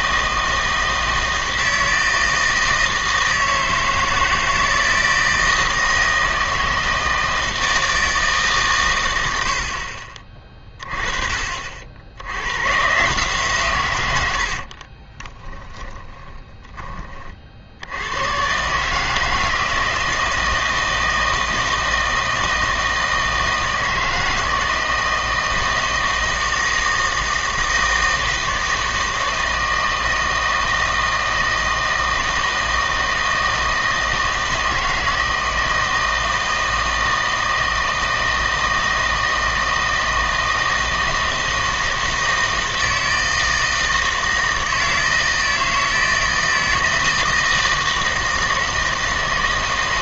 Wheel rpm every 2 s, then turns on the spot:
160, 160, 160, 160, 140, 30, 120, 40, 20, 150, 160, 160, 160, 160, 160, 160, 160, 160, 160, 160, 160, 160, 160, 160, 160.
14-16